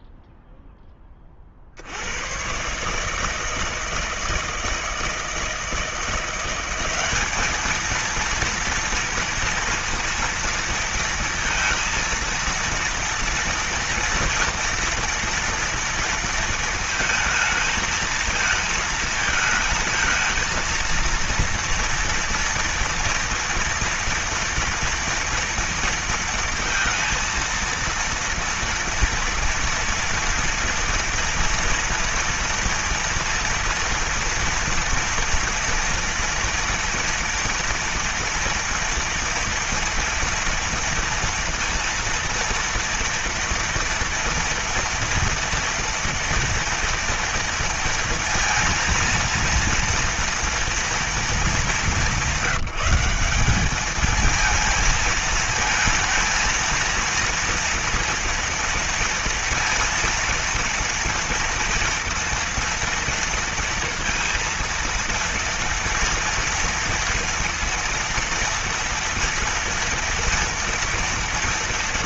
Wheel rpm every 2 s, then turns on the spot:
0, 120, 160, 180, 230, 230, 230, 230, 230, 220, 220, 230, 230, 230, 230, 230, 230, 230, 230, 240, 230, 230, 230, 230, 230, 240, 180, 220, 230, 230, 230, 230, 230, 230, 230, 230.
none